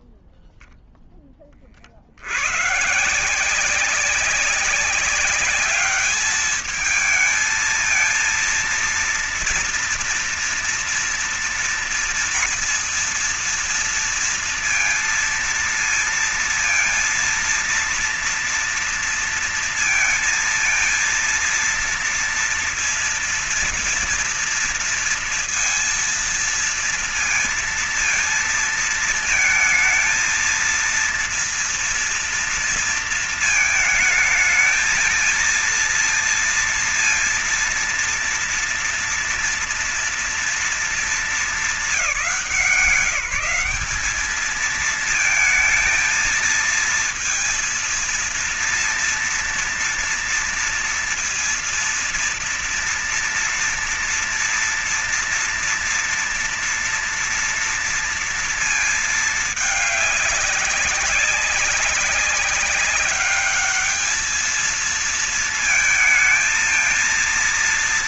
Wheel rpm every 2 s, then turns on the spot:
0, 110, 200, 210, 230, 230, 240, 230, 230, 230, 230, 230, 240, 230, 230, 230, 230, 220, 230, 230, 220, 170, 210, 230, 230, 230, 230, 230, 230, 230, 200, 200, 220, 230.
none